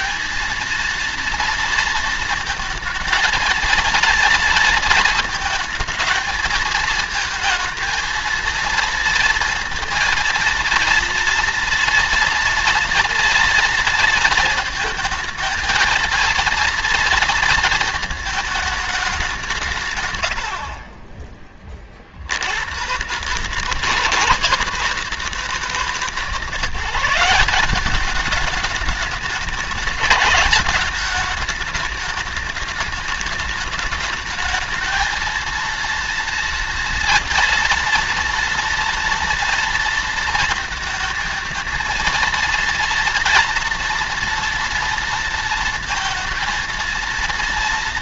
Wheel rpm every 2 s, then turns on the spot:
230, 220, 230, 220, 230, 230, 230, 220, 230, 210, 40, 120, 160, 180, 210, 210, 210, 220, 230, 230, 230, 230, 230, 230.
none